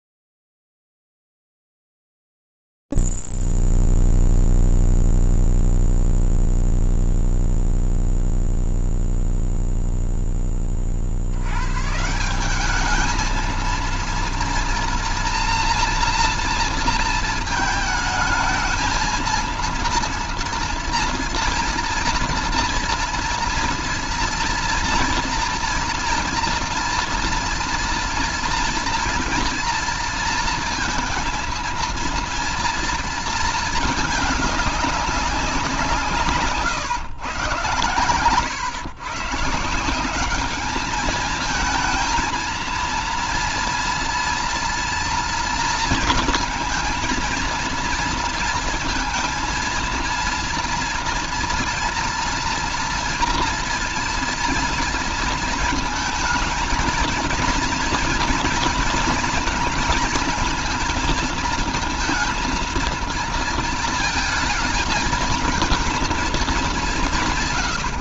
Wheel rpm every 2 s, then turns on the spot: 0, 0, 0, 0, 0, 10, 170, 240, 230, 220, 230, 230, 230, 230, 230, 230, 230, 210, 130, 130, 220, 230, 230, 230, 230, 230, 230, 230, 220, 230, 230, 230, 220, 180.
none